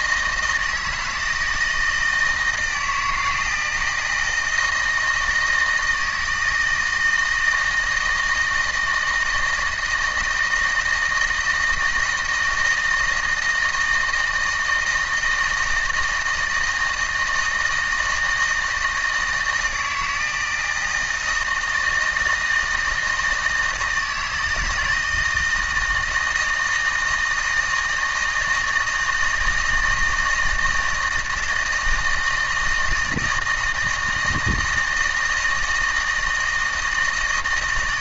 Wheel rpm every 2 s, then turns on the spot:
160, 160, 160, 160, 160, 170, 160, 160, 160, 160, 160, 160, 160, 160, 160, 160, 160, 160, 160.
none